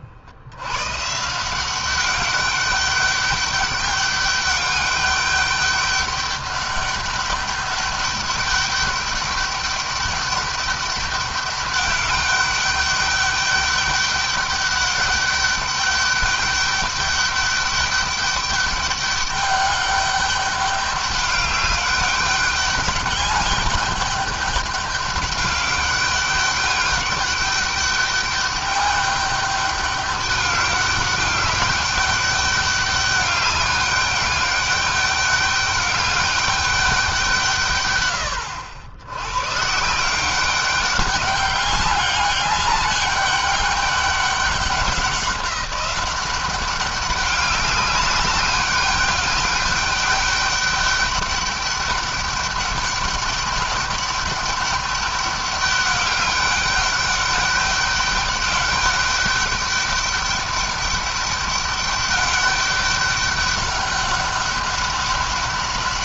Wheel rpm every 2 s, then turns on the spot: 110, 200, 200, 200, 210, 200, 200, 200, 200, 200, 200, 200, 200, 200, 200, 200, 200, 200, 200, 100, 200, 200, 190, 200, 200, 200, 200, 200, 200, 200, 200, 200, 200.
none